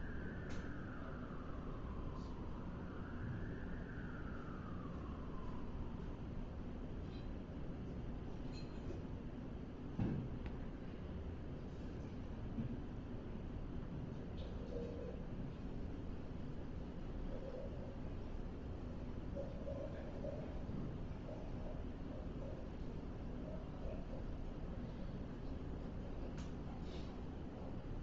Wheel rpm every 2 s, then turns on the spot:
0, 0, 0, 0, 0, 0, 0, 0, 0, 0, 0, 0, 0, 0.
none